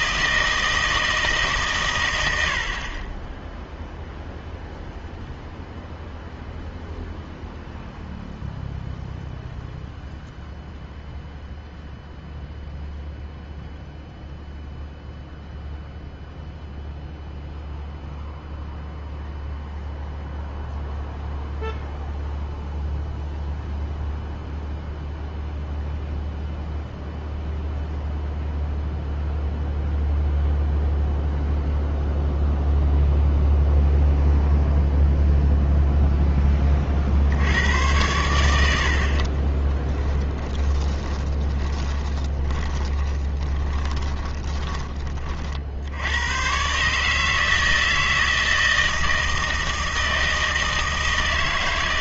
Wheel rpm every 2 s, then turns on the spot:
160, 60, 0, 0, 0, 0, 0, 0, 0, 0, 0, 0, 0, 0, 0, 0, 0, 0, 20, 80, 10, 30, 20, 130, 160, 160.
40-46